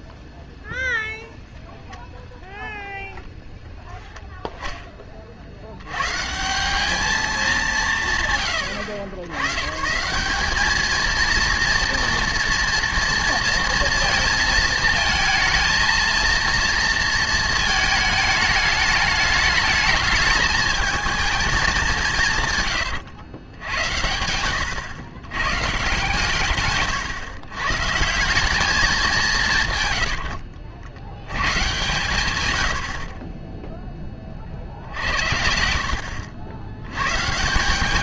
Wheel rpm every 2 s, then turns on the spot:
0, 10, 20, 200, 100, 220, 230, 230, 230, 210, 220, 100, 110, 130, 200, 80, 50, 70, 110.
22-24